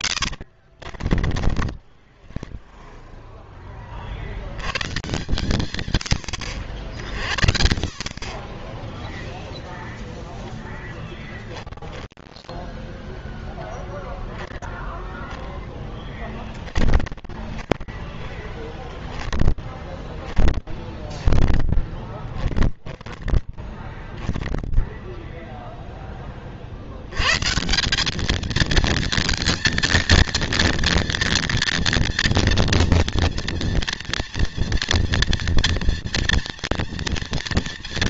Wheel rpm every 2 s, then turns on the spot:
70, 20, 80, 80, 20, 0, 10, 0, 10, 10, 10, 10, 10, 40, 220, 230, 230, 230, 230.
0-4 18-26